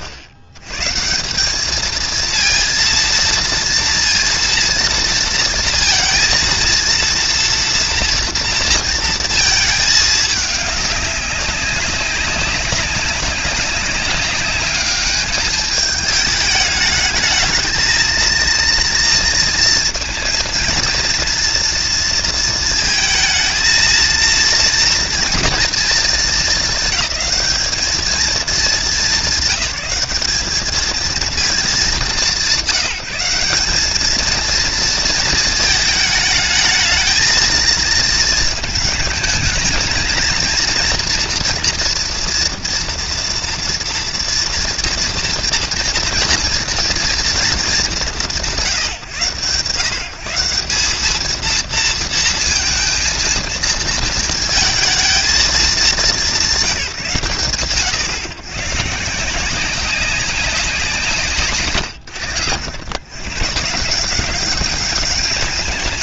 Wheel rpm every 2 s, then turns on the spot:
120, 230, 230, 230, 230, 200, 190, 210, 220, 230, 230, 230, 230, 220, 210, 220, 180, 230, 220, 220, 230, 230, 230, 230, 150, 210, 230, 220, 140, 140, 150, 110, 200.
none